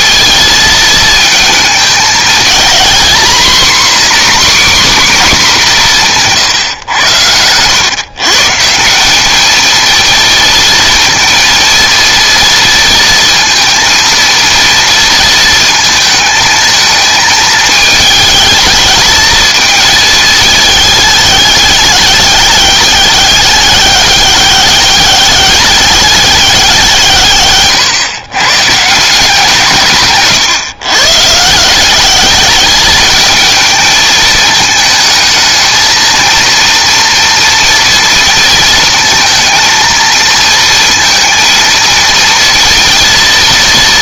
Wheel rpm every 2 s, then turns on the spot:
230, 230, 270, 130, 160, 230, 230, 230, 220, 220, 220, 200, 200, 190, 150, 130, 210, 220, 230, 230, 220, 230.
none